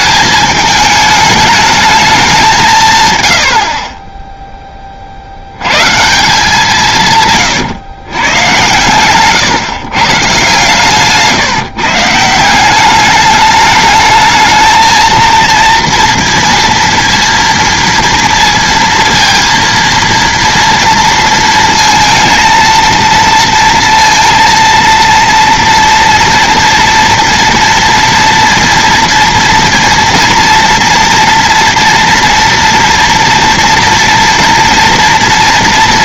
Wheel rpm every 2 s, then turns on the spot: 210, 170, 20, 160, 120, 130, 180, 220, 230, 230, 230, 230, 230, 240, 230, 230, 240, 230.
none